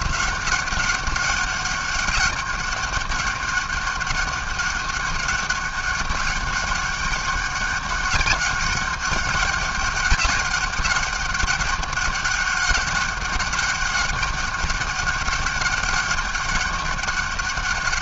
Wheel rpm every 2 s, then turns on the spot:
190, 200, 190, 200, 200, 200, 200, 200, 200.
none